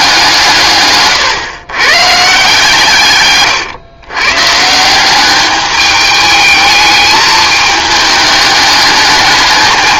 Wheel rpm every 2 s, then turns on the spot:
140, 150, 170, 220, 210.
none